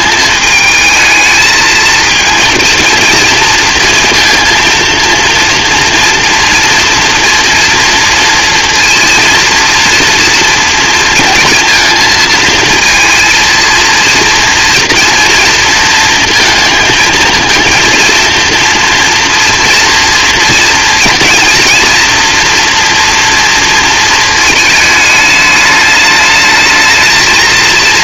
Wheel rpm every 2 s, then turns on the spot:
210, 230, 230, 230, 230, 230, 230, 230, 230, 230, 230, 230, 220, 220.
none